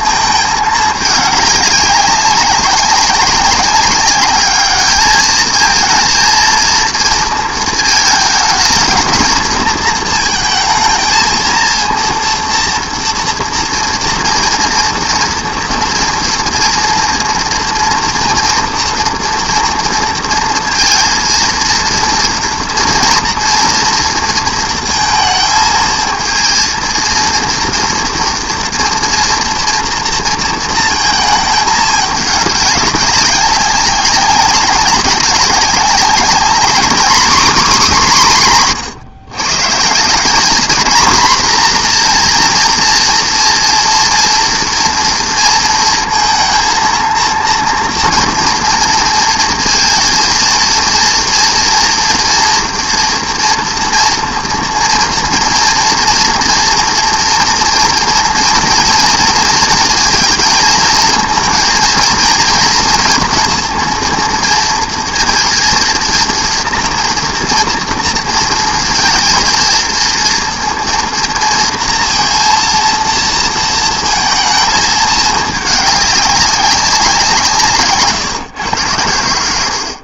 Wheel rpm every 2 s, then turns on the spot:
220, 200, 210, 230, 230, 230, 230, 230, 240, 230, 230, 240, 230, 230, 230, 230, 200, 200, 230, 170, 220, 230, 230, 230, 230, 230, 230, 230, 240, 240, 230, 230, 230, 230, 230, 230, 230, 220, 190, 120.
none